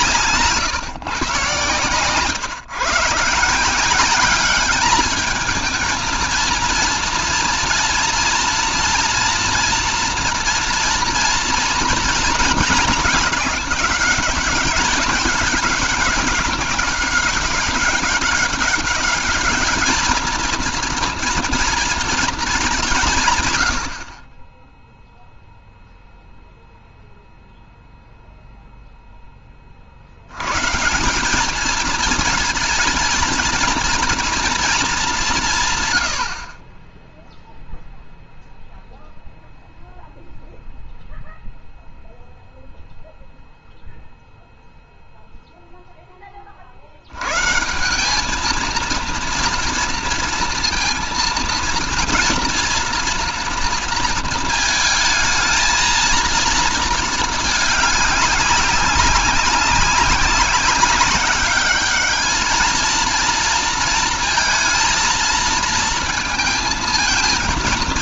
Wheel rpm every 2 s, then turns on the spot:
130, 140, 210, 230, 230, 230, 220, 190, 190, 200, 230, 170, 0, 0, 0, 150, 230, 210, 20, 0, 0, 0, 0, 60, 220, 230, 230, 220, 220, 200, 190, 230, 230, 220.
none